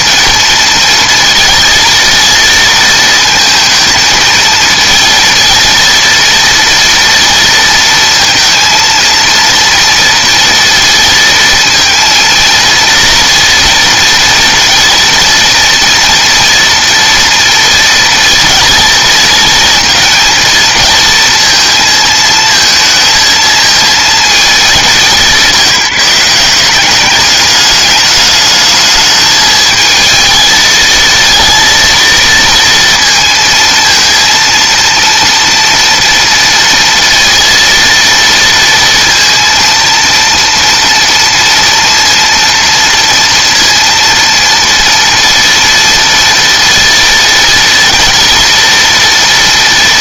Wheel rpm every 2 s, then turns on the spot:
230, 230, 230, 230, 230, 230, 230, 230, 240, 230, 230, 230, 220, 170, 210, 220, 230, 230, 230, 230, 230, 230, 230, 230, 230.
none